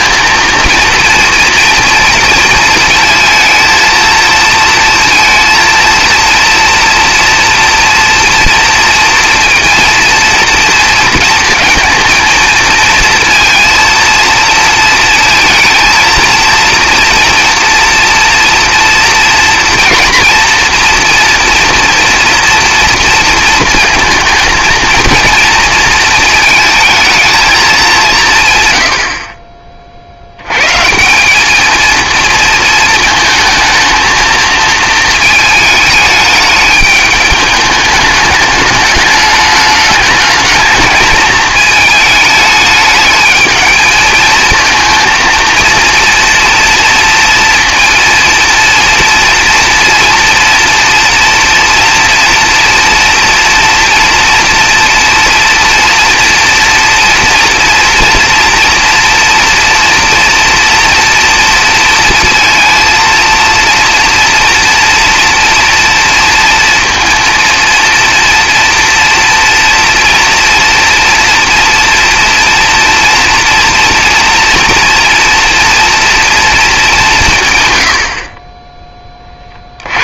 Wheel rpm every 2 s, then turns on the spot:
230, 230, 230, 230, 230, 230, 230, 230, 230, 230, 240, 230, 230, 230, 100, 140, 220, 230, 210, 210, 210, 210, 220, 230, 230, 230, 240, 230, 230, 230, 230, 230, 230, 230, 230, 230, 240, 230, 220, 20.
none